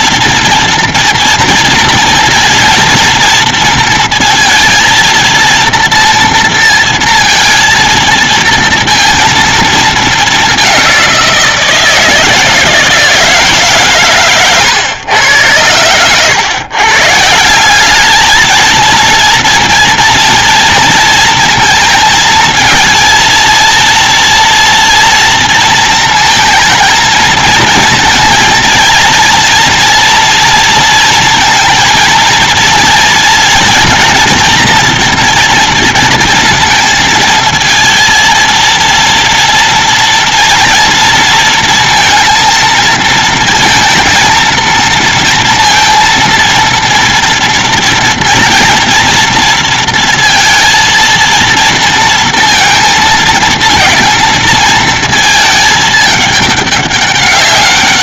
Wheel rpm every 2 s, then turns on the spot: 230, 230, 230, 230, 230, 210, 160, 130, 110, 210, 230, 230, 240, 230, 230, 230, 230, 240, 230, 230, 230, 230, 230, 230, 230, 230, 230, 220, 210.
none